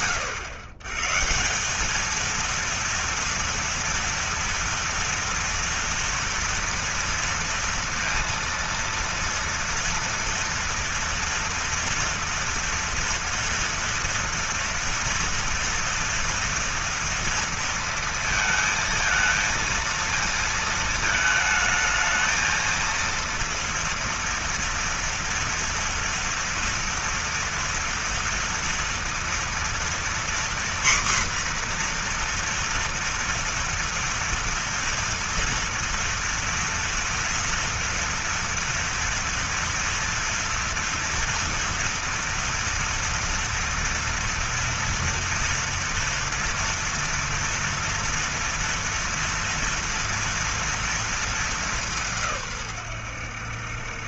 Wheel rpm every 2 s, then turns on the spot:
130, 230, 230, 230, 230, 230, 230, 230, 230, 230, 220, 230, 230, 230, 230, 250, 240, 230, 230, 230, 240, 240, 230, 230, 230, 230, 110.
none